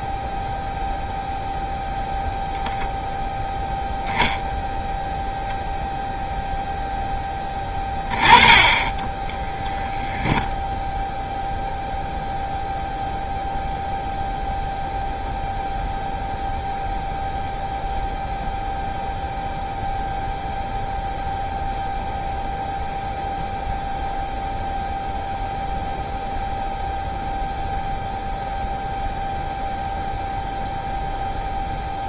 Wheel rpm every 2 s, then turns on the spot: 0, 0, 0, 0, 20, 0, 0, 0, 0, 0, 0, 0, 0, 0, 0, 0.
none